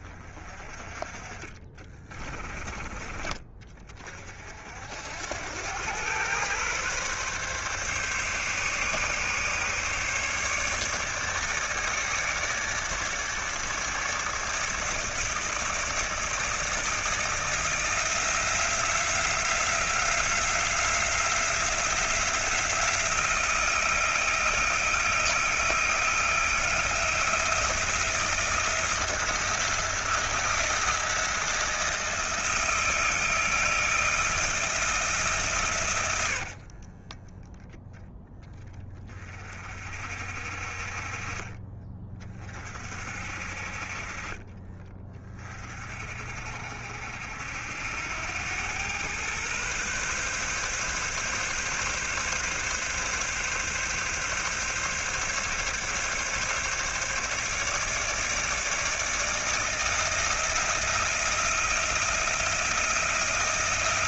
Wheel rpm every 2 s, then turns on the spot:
30, 40, 70, 130, 140, 150, 150, 150, 160, 170, 180, 170, 170, 170, 160, 170, 170, 160, 40, 20, 40, 50, 30, 60, 110, 140, 140, 140, 140, 150, 170, 170.
36-38